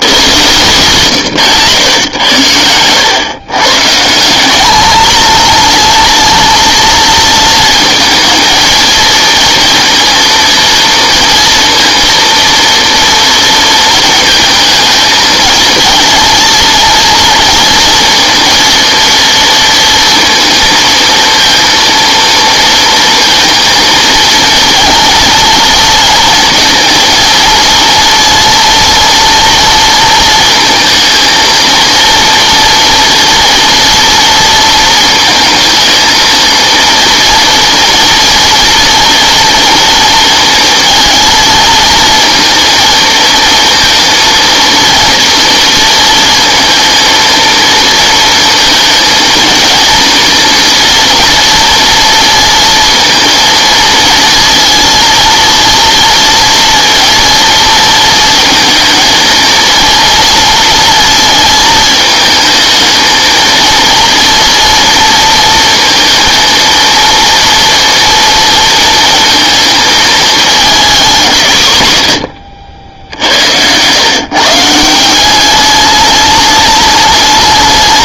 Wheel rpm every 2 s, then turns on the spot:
130, 110, 200, 230, 230, 230, 230, 220, 230, 230, 230, 230, 230, 230, 230, 220, 230, 230, 230, 240, 220, 230, 230, 220, 230, 230, 230, 230, 240, 220, 230, 220, 230, 230, 230, 210, 80, 160, 210.
72-74